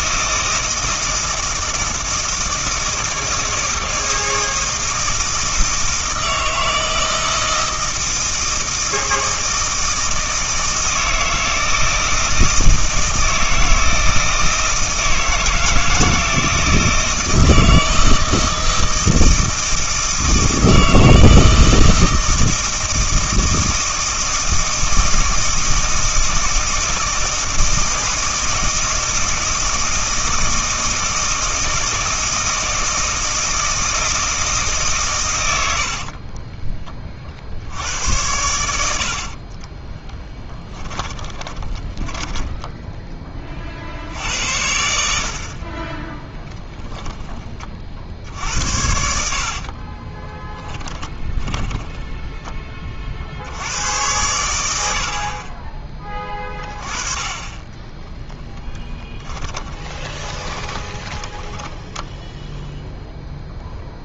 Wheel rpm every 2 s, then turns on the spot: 160, 160, 160, 160, 160, 160, 160, 160, 160, 160, 160, 160, 160, 160, 160, 160, 160, 150, 30, 70, 10, 10, 70, 20, 70, 10, 30, 80, 20, 10, 10, 0.
36-38 40-42 50-52 58-62